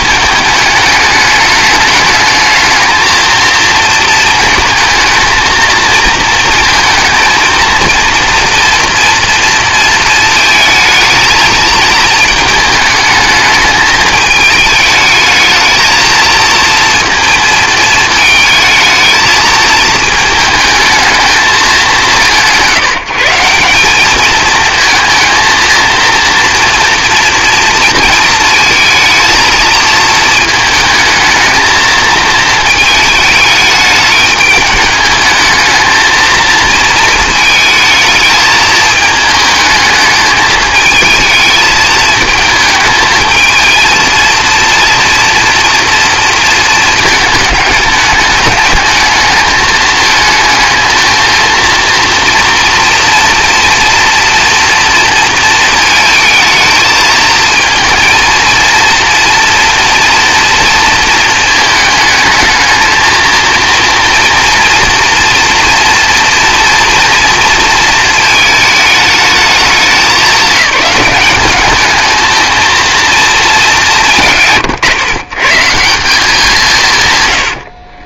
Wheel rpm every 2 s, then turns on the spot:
210, 220, 220, 230, 240, 220, 220, 210, 230, 220, 220, 170, 220, 230, 220, 220, 220, 210, 220, 220, 220, 220, 230, 220, 210, 220, 230, 240, 220, 230, 230, 220, 230, 230, 220, 190, 220, 150, 180.
none